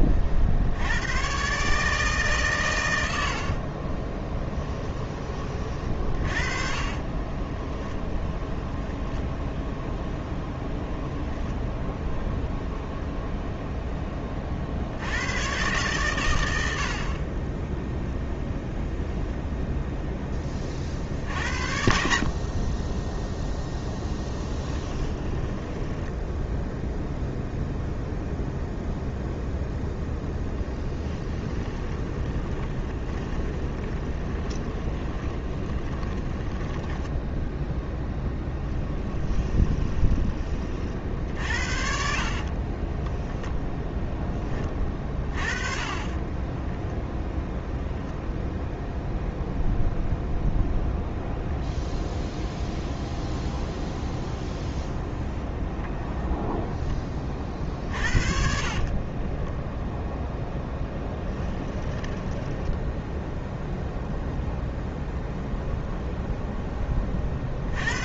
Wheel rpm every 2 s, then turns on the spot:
100, 100, 10, 30, 0, 10, 0, 70, 70, 0, 40, 10, 20, 0, 0, 10, 20, 20, 10, 10, 40, 30, 30, 10, 0, 0, 0, 0, 20, 30, 0, 0, 0, 20.
6-8 24-26 30-40 42-44 46-48 58-60